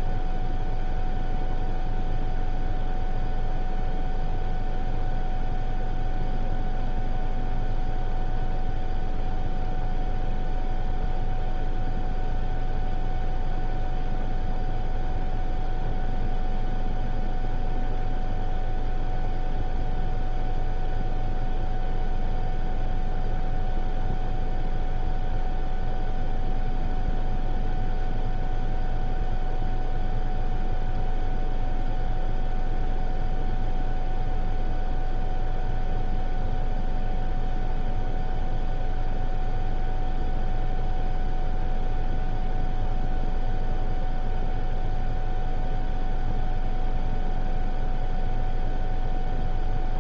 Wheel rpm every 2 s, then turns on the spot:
0, 0, 0, 0, 0, 0, 0, 0, 0, 0, 0, 0, 0, 0, 0, 0, 0, 0, 0, 0, 0, 0, 0, 0, 0.
none